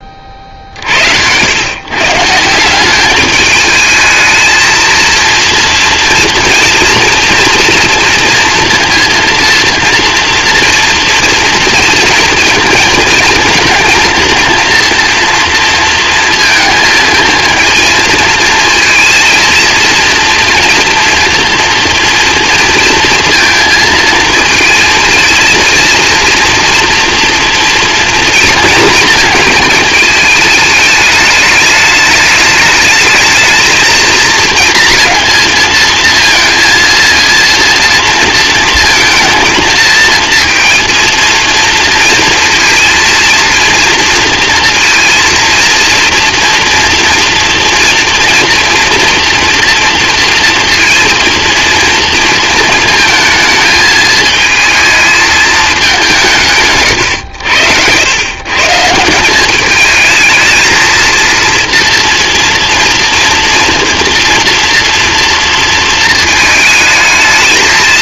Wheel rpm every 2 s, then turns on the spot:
90, 200, 230, 230, 230, 230, 220, 230, 220, 230, 230, 230, 220, 230, 230, 210, 210, 230, 230, 230, 230, 230, 230, 230, 230, 230, 220, 220, 100, 180, 230, 230, 230, 220.
none